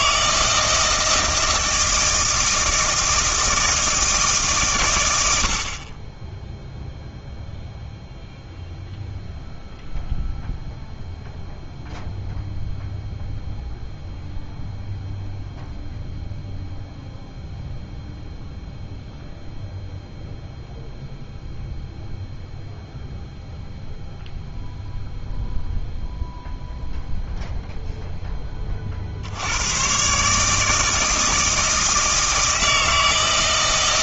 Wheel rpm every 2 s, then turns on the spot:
160, 160, 130, 0, 0, 0, 0, 0, 0, 0, 0, 0, 0, 0, 20, 150, 160.
none